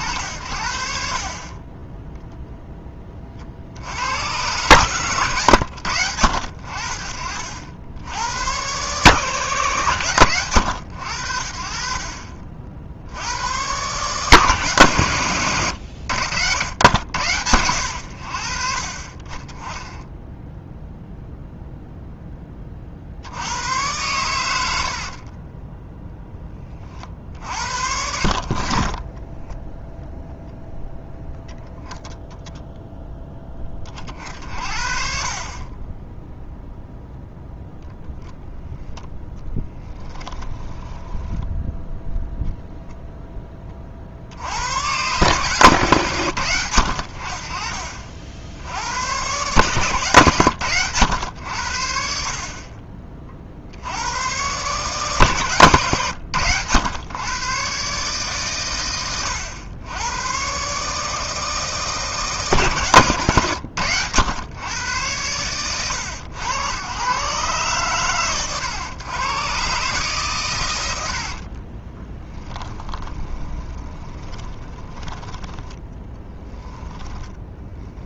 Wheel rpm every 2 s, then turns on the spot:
60, 10, 120, 60, 120, 80, 70, 110, 80, 40, 0, 50, 70, 30, 30, 0, 0, 50, 0, 0, 10, 0, 100, 80, 90, 110, 30, 140, 110, 110, 140, 140, 100, 110, 110, 100, 20, 10, 10.
40-42 72-78